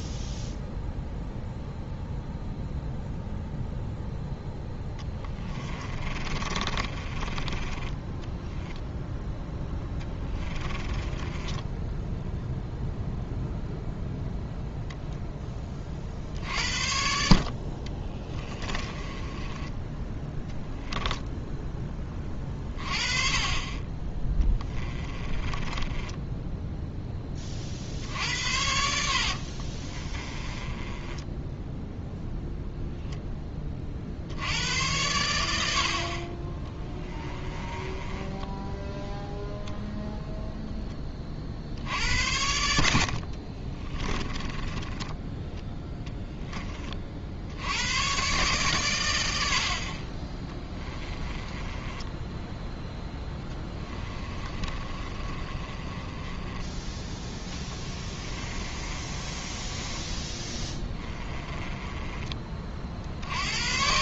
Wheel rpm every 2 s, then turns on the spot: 0, 0, 10, 30, 10, 20, 0, 0, 50, 20, 0, 30, 20, 10, 70, 20, 0, 80, 20, 10, 0, 70, 20, 20, 120, 20, 10, 30, 10, 30, 20, 40.
4-12 18-20 24-26 28-32 36-40 44-46 50-52 54-62